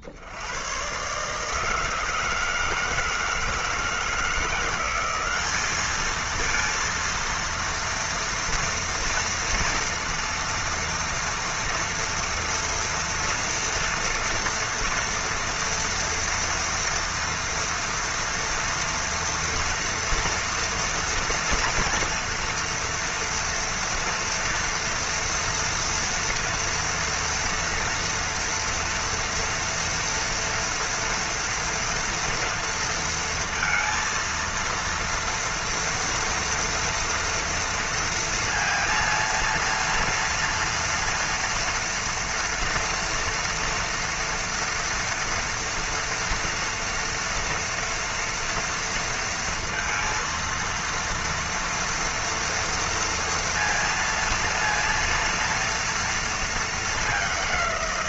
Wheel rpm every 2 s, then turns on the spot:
60, 160, 170, 220, 230, 230, 230, 230, 240, 230, 230, 230, 230, 230, 240, 230, 230, 230, 230, 230, 230, 230, 240, 230, 230, 230, 230, 230, 230.
none